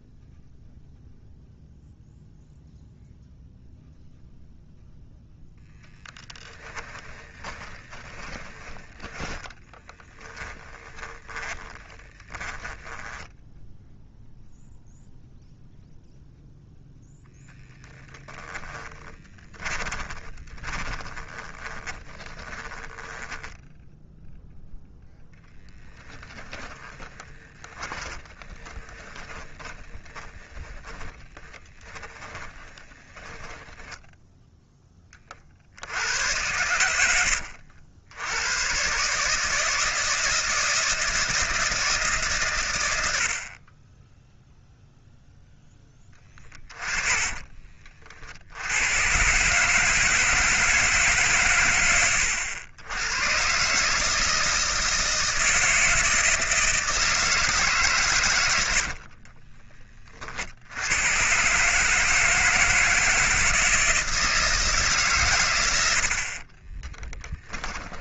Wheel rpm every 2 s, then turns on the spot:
0, 0, 0, 10, 20, 20, 10, 0, 0, 10, 20, 10, 0, 30, 20, 20, 10, 10, 100, 120, 160, 110, 0, 30, 90, 150, 100, 160, 160, 70, 90, 160, 150, 30.
6-8 10-14 18-22 26-34 46-48 58-60 66-68